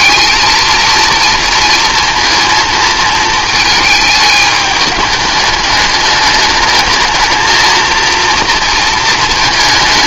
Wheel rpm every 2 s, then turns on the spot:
220, 220, 210, 210, 230.
none